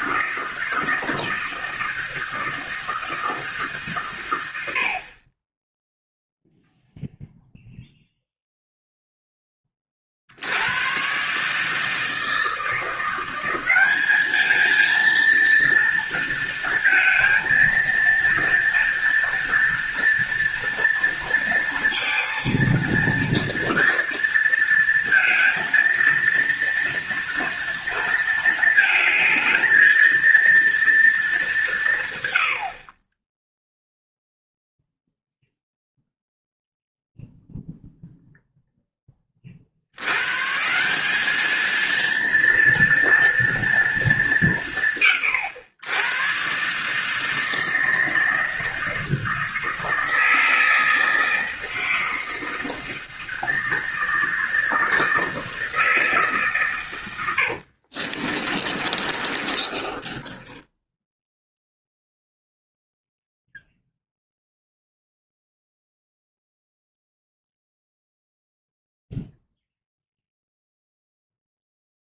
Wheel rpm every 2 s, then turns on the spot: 160, 160, 80, 0, 0, 80, 160, 220, 230, 230, 230, 230, 230, 230, 230, 230, 70, 0, 0, 0, 150, 230, 180, 130, 160, 160, 160, 160, 130, 30, 10, 0, 0, 0, 0, 0.
58-62